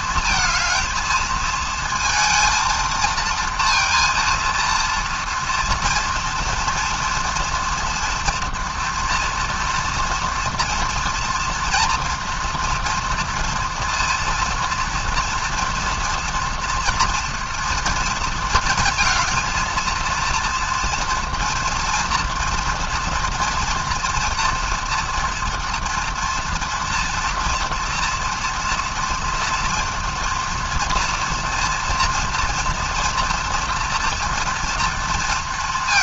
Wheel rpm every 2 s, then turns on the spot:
230, 230, 230, 230, 230, 230, 230, 230, 240, 230, 230, 230, 230, 230, 230, 230, 230, 230.
none